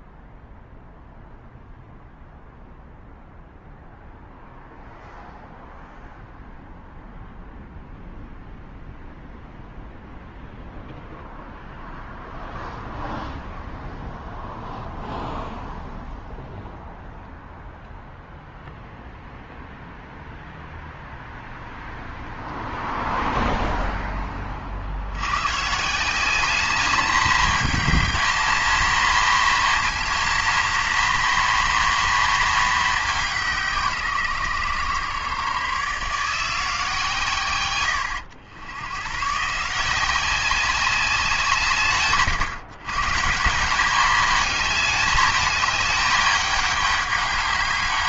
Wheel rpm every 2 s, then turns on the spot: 0, 0, 0, 0, 0, 0, 0, 0, 0, 0, 0, 0, 60, 210, 230, 230, 220, 130, 150, 90, 190, 140, 210, 200.
none